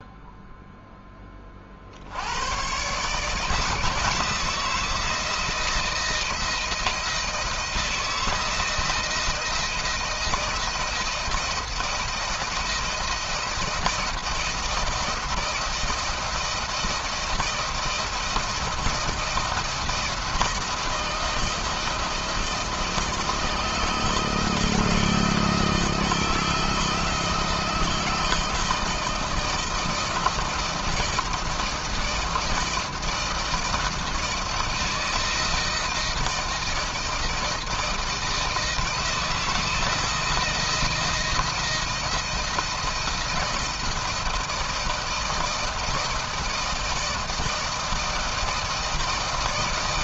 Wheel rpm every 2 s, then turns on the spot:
0, 90, 160, 160, 160, 170, 160, 160, 160, 170, 170, 170, 160, 160, 160, 160, 160, 160, 160, 160, 160, 160, 160, 160, 160.
none